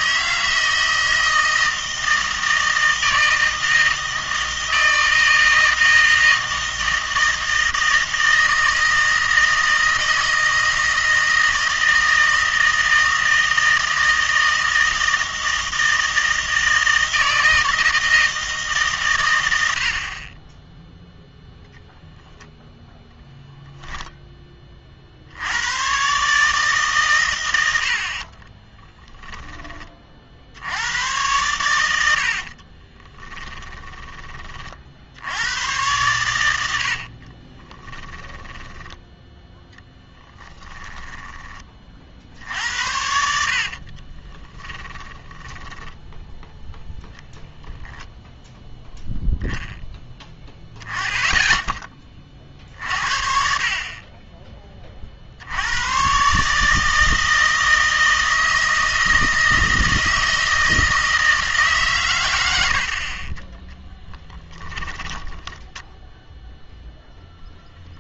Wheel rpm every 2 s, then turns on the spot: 160, 160, 160, 160, 160, 160, 160, 160, 160, 140, 10, 0, 30, 140, 10, 90, 40, 40, 80, 10, 10, 70, 20, 0, 0, 10, 50, 30, 160, 160, 160, 90, 10, 0.
28-30 32-34 36-42 44-46 64-66